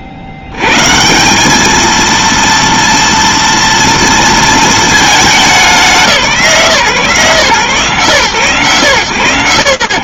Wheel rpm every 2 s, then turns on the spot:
40, 230, 230, 170, 130.
none